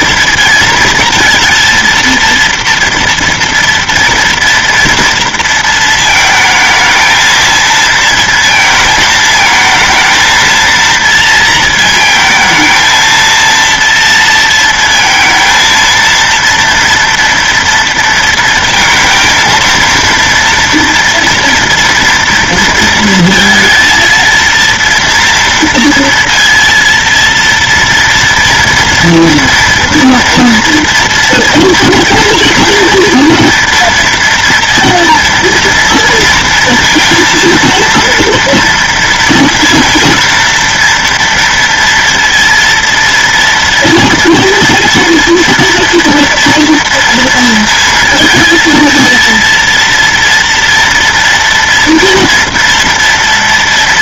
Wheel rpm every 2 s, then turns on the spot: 230, 230, 230, 220, 220, 230, 220, 230, 230, 220, 230, 230, 230, 230, 230, 230, 230, 230, 230, 230, 230, 230, 230, 230, 230, 230, 230.
none